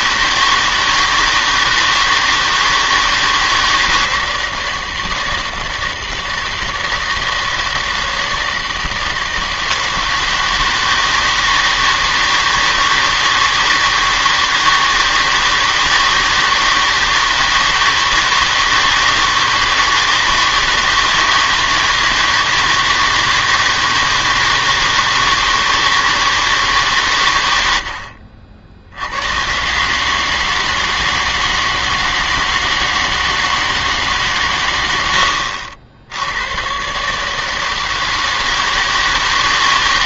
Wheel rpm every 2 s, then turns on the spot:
160, 160, 160, 160, 160, 160, 160, 160, 160, 160, 160, 160, 160, 150, 60, 160, 160, 110, 100, 160.
none